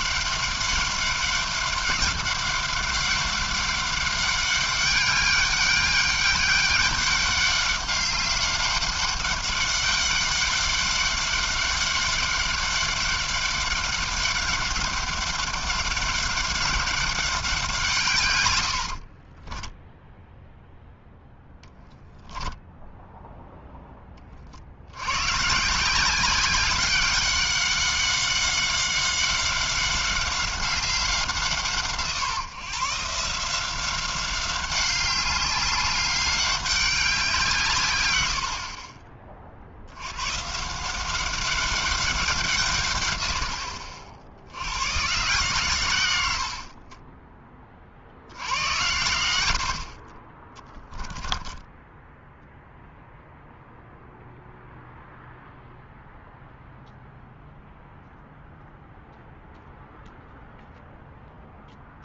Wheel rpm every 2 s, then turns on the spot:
200, 200, 200, 200, 200, 200, 200, 200, 200, 110, 0, 0, 50, 190, 200, 190, 140, 190, 200, 60, 140, 170, 80, 80, 80, 20, 0, 0, 0, 0, 0.
46-48 50-52